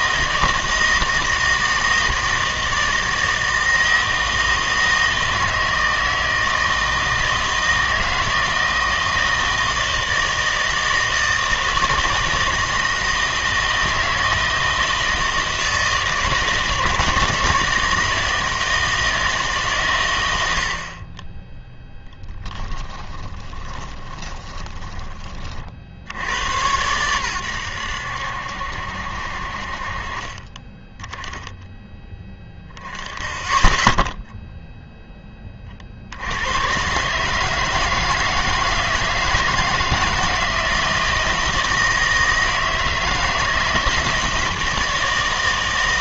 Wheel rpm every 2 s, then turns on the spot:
160, 160, 160, 160, 160, 160, 160, 160, 160, 160, 80, 10, 20, 100, 70, 20, 10, 0, 110, 160, 160, 160, 160.
22-26